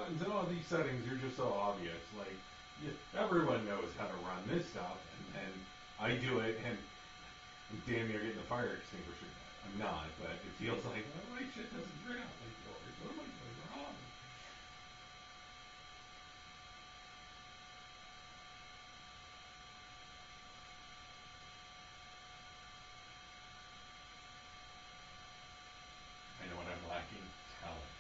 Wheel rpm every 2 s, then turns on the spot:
0, 0, 0, 0, 0, 0, 0, 0, 0, 0, 0, 0, 0, 0.
none